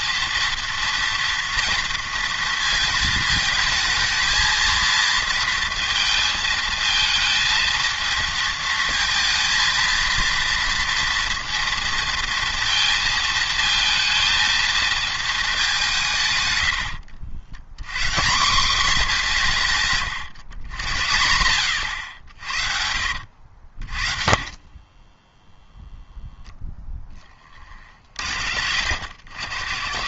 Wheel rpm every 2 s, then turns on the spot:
230, 220, 230, 220, 230, 230, 230, 230, 80, 210, 110, 70, 30, 0, 70.
16-18 22-26